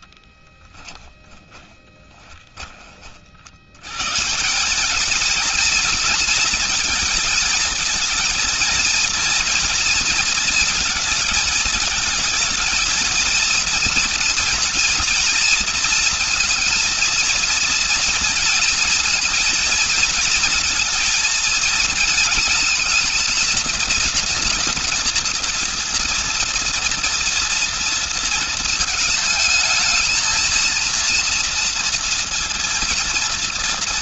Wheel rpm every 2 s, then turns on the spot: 10, 30, 180, 230, 230, 230, 230, 240, 230, 220, 230, 230, 240, 230, 230, 230, 230.
0-2